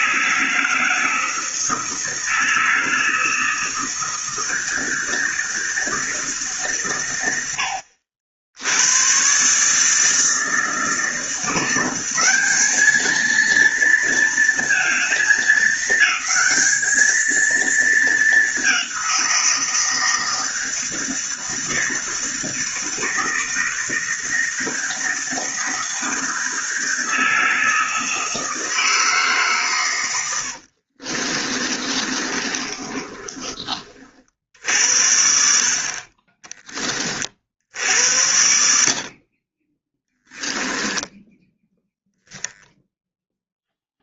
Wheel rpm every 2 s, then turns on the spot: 160, 160, 160, 150, 80, 160, 200, 230, 220, 200, 160, 160, 160, 160, 160, 90, 30, 60, 20, 70, 10, 0.
30-34 40-42